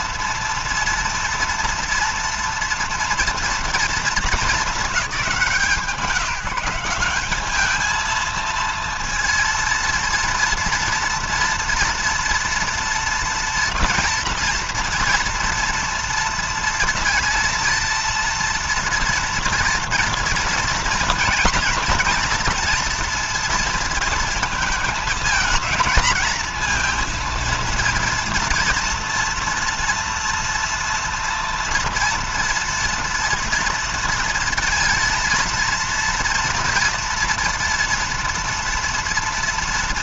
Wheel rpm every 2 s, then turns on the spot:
230, 240, 180, 200, 230, 230, 230, 230, 230, 230, 230, 230, 230, 230, 230, 240, 230, 230, 230, 230.
none